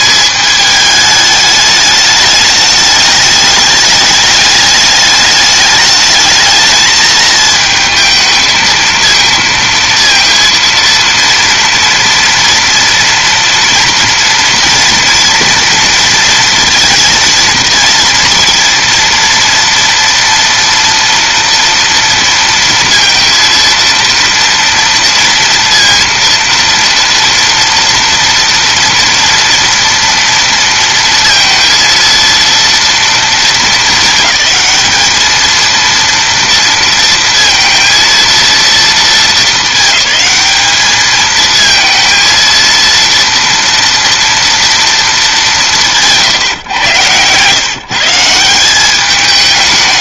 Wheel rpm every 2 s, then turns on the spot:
210, 210, 210, 220, 220, 230, 230, 230, 230, 230, 230, 230, 230, 230, 230, 230, 230, 220, 230, 230, 210, 230, 230, 120, 190.
none